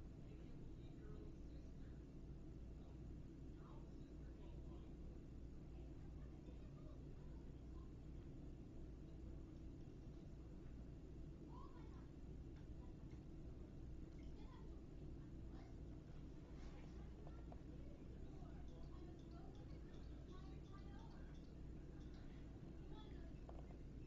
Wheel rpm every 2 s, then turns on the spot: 0, 0, 0, 0, 0, 0, 0, 0, 0, 0, 0, 0.
none